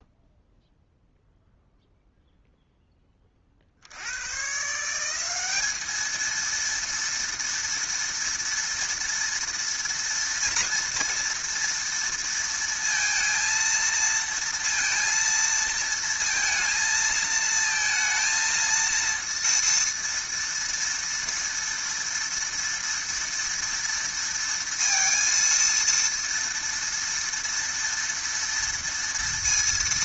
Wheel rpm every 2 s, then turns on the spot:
0, 0, 120, 230, 230, 230, 230, 230, 230, 230, 230, 230, 230, 230, 230.
none